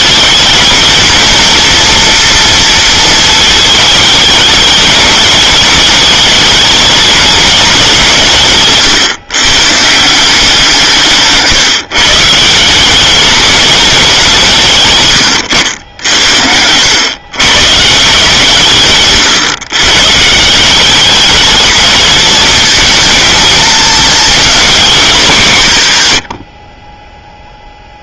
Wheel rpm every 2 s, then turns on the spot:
220, 220, 210, 210, 140, 170, 200, 110, 100, 120, 200, 230, 210, 20.
10-12 26-28